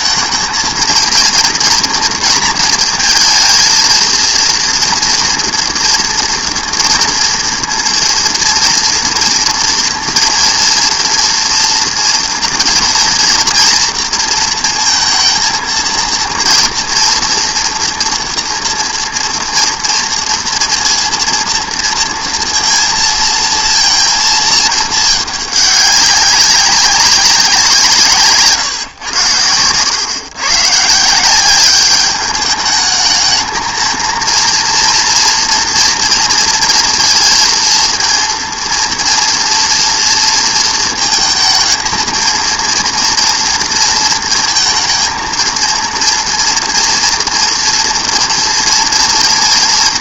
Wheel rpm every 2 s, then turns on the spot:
220, 230, 230, 230, 240, 230, 240, 230, 230, 230, 230, 230, 220, 200, 140, 140, 210, 230, 230, 230, 230, 230, 230, 230, 230.
none